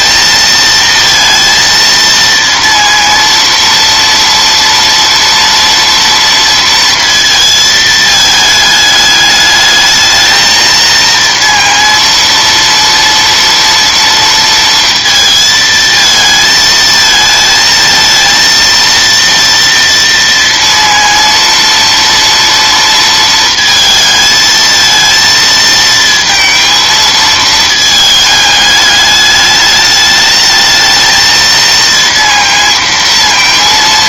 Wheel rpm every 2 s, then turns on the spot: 230, 230, 230, 230, 220, 220, 230, 230, 220, 230, 230, 230, 220, 230, 210, 220, 230.
none